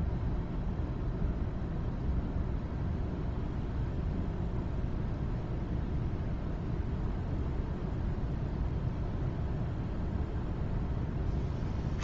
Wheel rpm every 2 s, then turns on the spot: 0, 0, 0, 0, 0, 0.
none